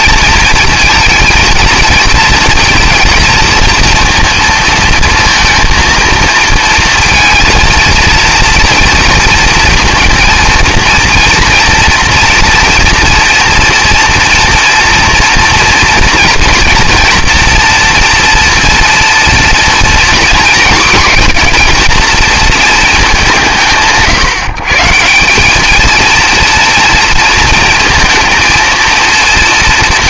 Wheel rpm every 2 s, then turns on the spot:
230, 230, 230, 230, 230, 230, 230, 230, 230, 230, 230, 220, 150, 230, 230.
none